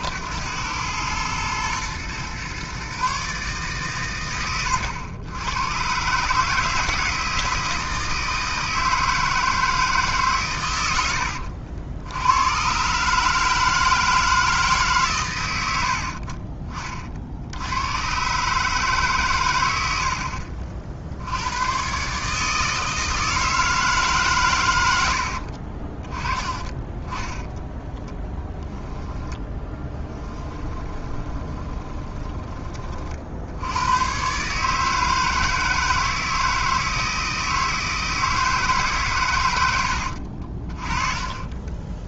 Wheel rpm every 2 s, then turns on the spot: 90, 130, 110, 160, 160, 120, 110, 160, 40, 150, 60, 160, 110, 20, 10, 20, 30, 150, 160, 150, 30.
26-32 40-42